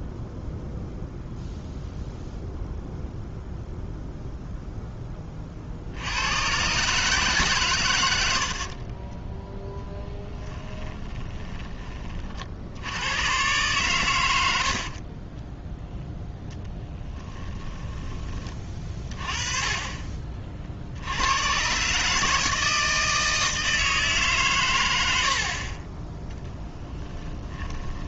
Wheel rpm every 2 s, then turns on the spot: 0, 0, 10, 140, 40, 10, 80, 60, 10, 30, 60, 160, 100, 10.
8-12 14-18 26-28